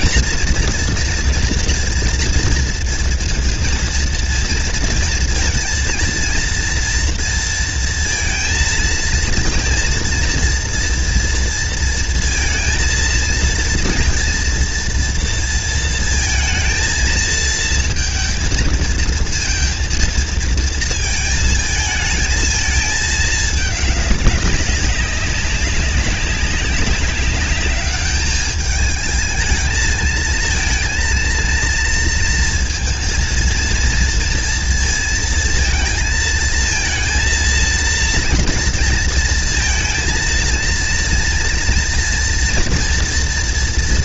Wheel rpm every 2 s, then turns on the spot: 240, 230, 230, 230, 230, 230, 230, 230, 230, 230, 230, 220, 200, 200, 220, 230, 230, 230, 230, 230, 230, 240.
none